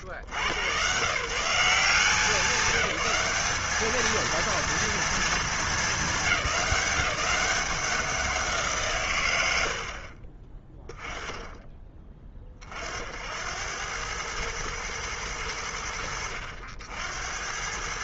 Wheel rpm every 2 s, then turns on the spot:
90, 190, 230, 200, 180, 30, 30, 100, 60.
none